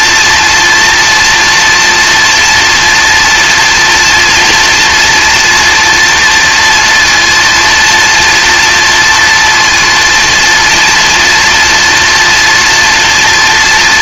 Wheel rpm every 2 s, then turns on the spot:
230, 240, 240, 230, 240, 230, 230.
none